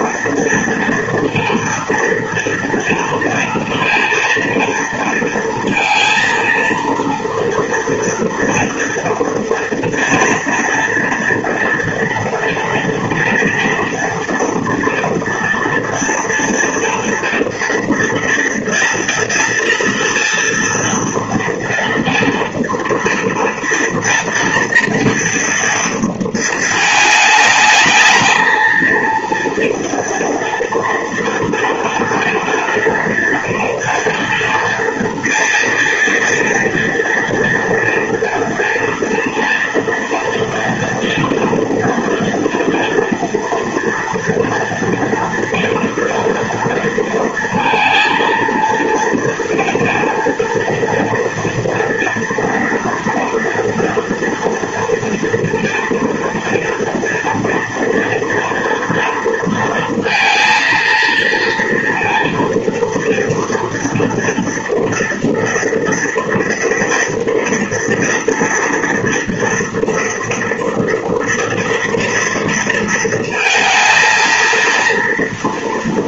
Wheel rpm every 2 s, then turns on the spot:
230, 240, 230, 230, 230, 230, 240, 230, 230, 230, 230, 230, 230, 230, 220, 230, 230, 240, 230, 230, 230, 230, 230, 230, 230, 230, 240, 230, 240, 230, 230, 230, 230, 230, 230, 230, 230, 220.
none